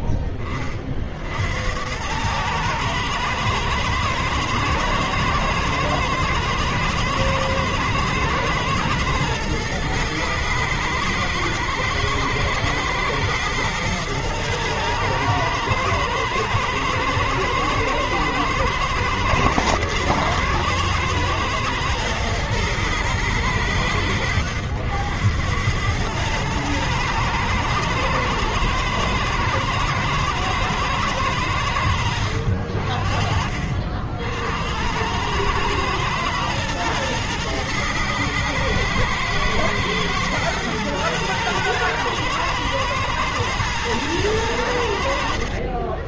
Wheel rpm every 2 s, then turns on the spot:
10, 110, 110, 110, 110, 110, 120, 110, 110, 110, 120, 110, 90, 110, 110, 100, 50, 110, 110, 120, 110, 110, 60.
none